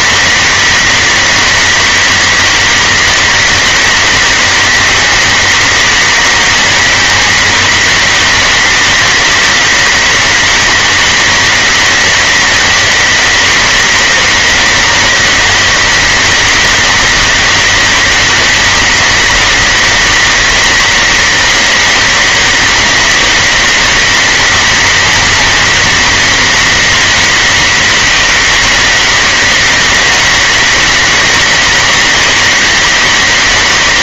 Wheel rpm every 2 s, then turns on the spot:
200, 200, 200, 200, 200, 200, 200, 200, 200, 200, 200, 200, 200, 200, 200, 200, 200.
none